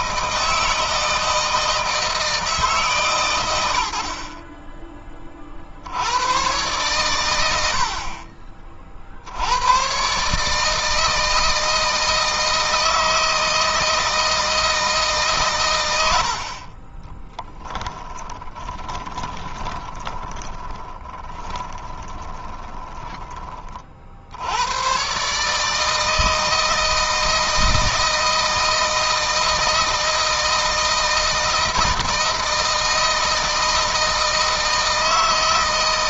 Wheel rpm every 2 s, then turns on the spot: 160, 150, 30, 120, 40, 150, 160, 160, 40, 20, 20, 20, 110, 160, 160, 160, 160, 160.
18-24